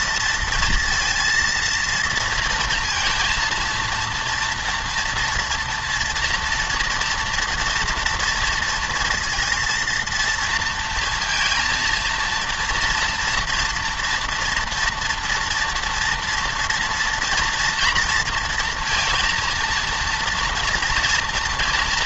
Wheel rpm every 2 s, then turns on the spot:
230, 230, 230, 230, 230, 230, 230, 240, 230, 230, 230.
none